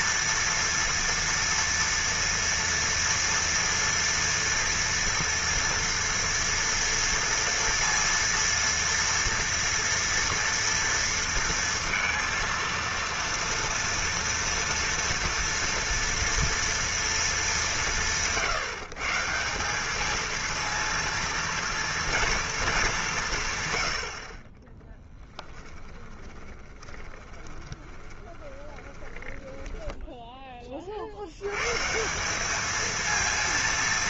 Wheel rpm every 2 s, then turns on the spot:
230, 230, 230, 230, 230, 230, 230, 230, 230, 150, 230, 230, 30, 30, 20, 20, 210.
26-30